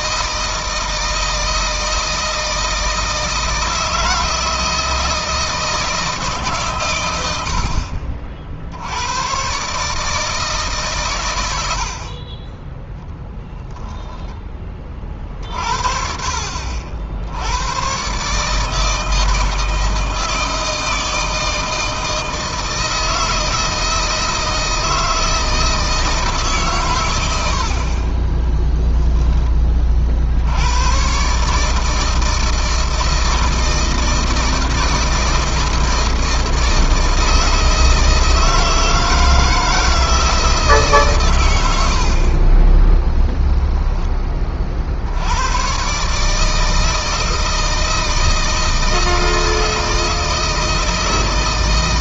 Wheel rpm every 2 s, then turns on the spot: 160, 160, 160, 130, 70, 140, 10, 20, 60, 150, 160, 160, 160, 130, 10, 100, 160, 160, 160, 170, 150, 20, 40, 160, 160, 160.
28-30 42-44